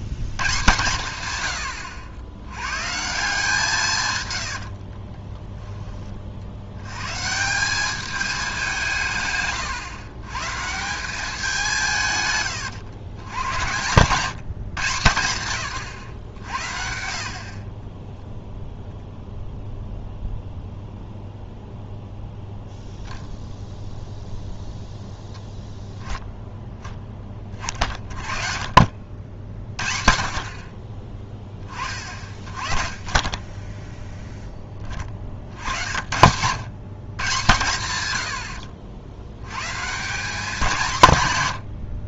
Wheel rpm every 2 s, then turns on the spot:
140, 140, 50, 90, 180, 170, 100, 140, 70, 0, 0, 0, 0, 10, 50, 40, 30, 20, 120, 70, 190.
4-6